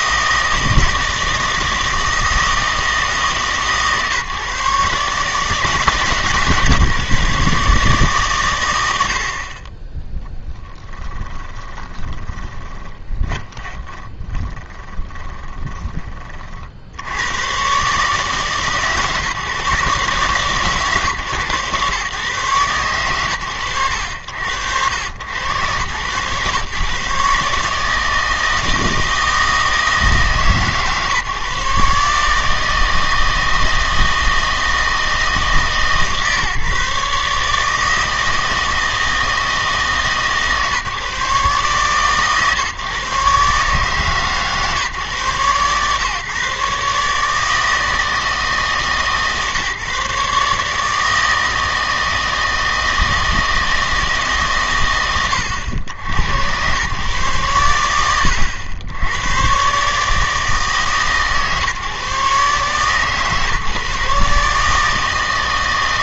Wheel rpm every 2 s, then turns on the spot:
160, 160, 150, 150, 110, 10, 30, 30, 50, 140, 130, 120, 80, 130, 160, 150, 150, 160, 150, 160, 140, 140, 140, 140, 160, 150, 160, 130, 100, 100, 150, 140, 150.
10-16